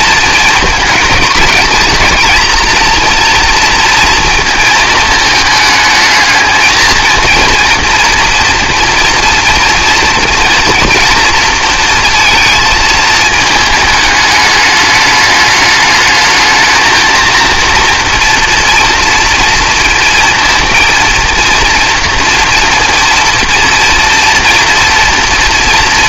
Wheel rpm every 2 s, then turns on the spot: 220, 220, 230, 220, 230, 230, 230, 210, 220, 240, 230, 230, 230.
none